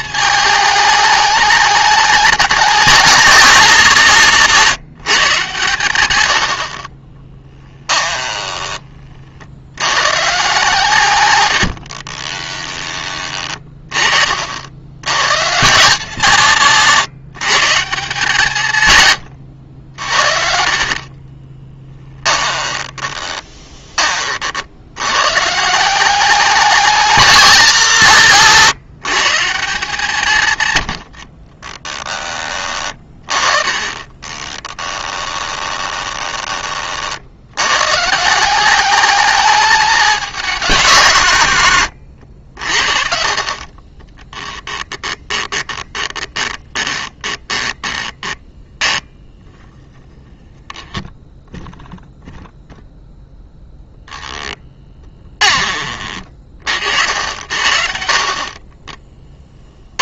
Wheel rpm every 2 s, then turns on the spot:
220, 200, 170, 50, 20, 140, 20, 60, 160, 120, 50, 20, 60, 200, 150, 110, 20, 20, 30, 200, 190, 60, 10, 20, 10, 10, 0, 10, 60, 30.
12-14 16-18 20-24 32-36 44-50 58-60